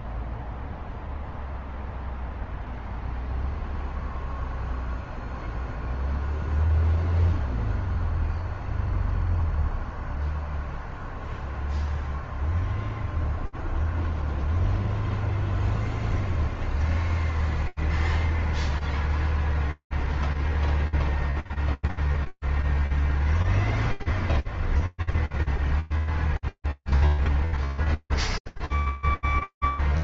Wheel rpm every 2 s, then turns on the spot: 0, 0, 0, 0, 0, 0, 0, 0, 0, 0, 0, 0, 0, 0, 0.
none